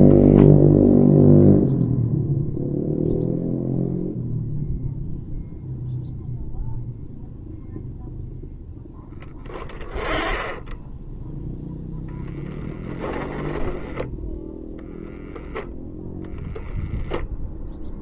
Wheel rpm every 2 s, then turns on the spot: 0, 0, 0, 0, 0, 10, 20, 0, 0.
12-14